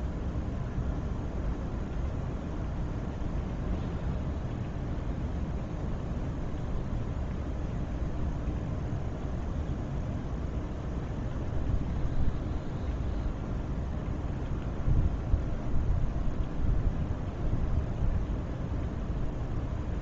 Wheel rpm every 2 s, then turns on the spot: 0, 0, 0, 0, 0, 0, 0, 0, 0, 0.
none